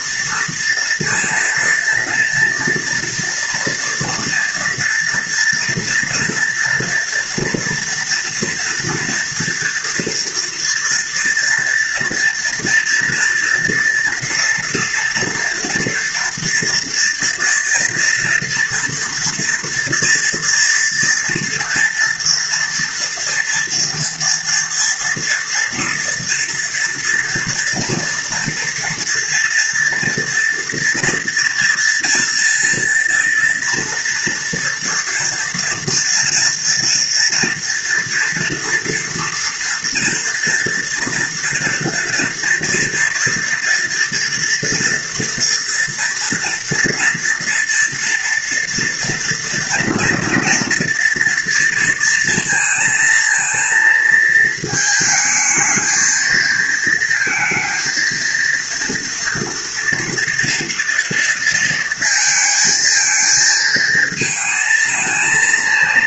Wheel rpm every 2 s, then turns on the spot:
230, 230, 230, 230, 230, 230, 230, 230, 230, 230, 230, 230, 230, 230, 230, 240, 230, 230, 230, 230, 230, 230, 230, 240, 240, 230, 230, 220, 230, 230, 230, 220, 230.
none